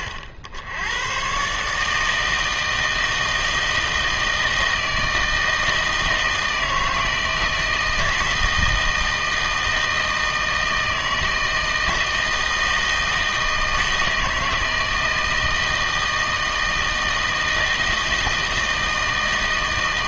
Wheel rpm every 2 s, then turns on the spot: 80, 160, 160, 160, 160, 160, 160, 160, 160, 160.
none